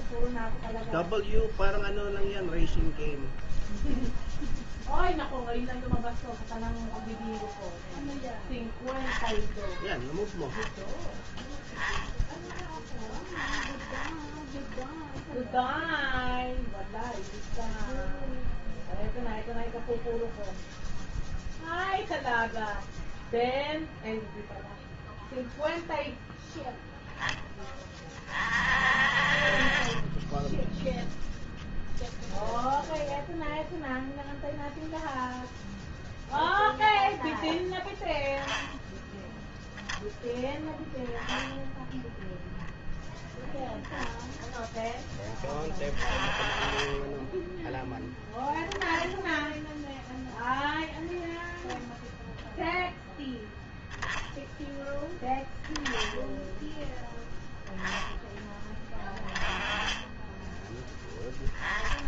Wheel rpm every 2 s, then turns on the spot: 0, 0, 0, 0, 10, 0, 10, 0, 0, 0, 0, 0, 0, 10, 40, 0, 0, 0, 0, 0, 0, 0, 10, 10, 10, 0, 0, 10, 10, 20, 10.
none